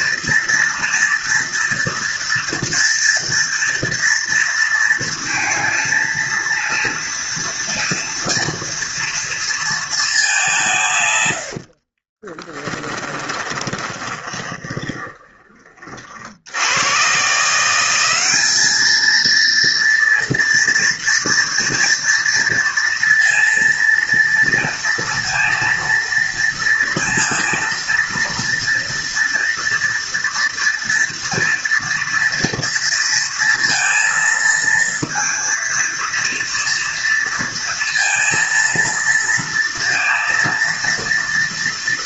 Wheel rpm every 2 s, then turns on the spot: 240, 230, 230, 230, 230, 90, 30, 20, 160, 230, 230, 230, 230, 230, 230, 230, 230, 230, 230, 230, 240.
12-14